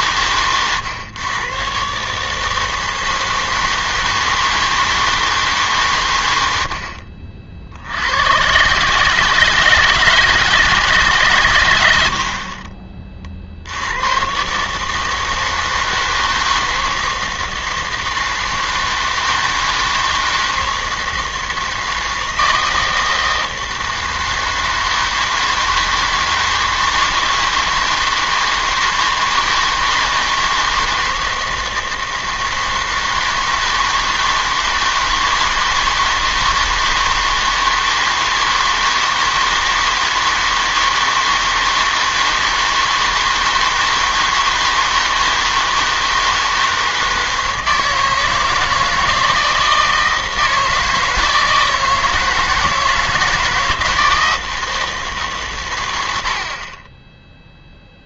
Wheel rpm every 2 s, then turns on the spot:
120, 160, 160, 80, 130, 160, 40, 140, 160, 160, 160, 160, 160, 160, 160, 160, 160, 160, 160, 160, 160, 160, 160, 160, 160, 160, 160, 160, 30.
none